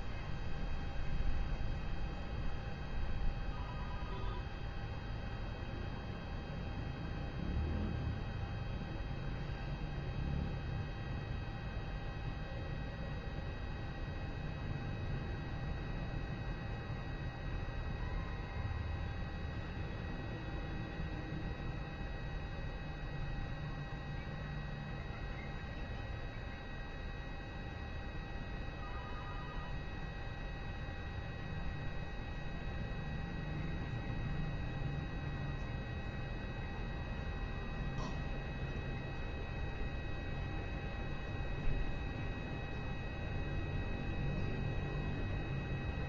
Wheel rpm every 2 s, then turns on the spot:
0, 0, 0, 0, 0, 0, 0, 0, 0, 0, 0, 0, 0, 0, 0, 0, 0, 0, 0, 0, 0, 0, 0.
none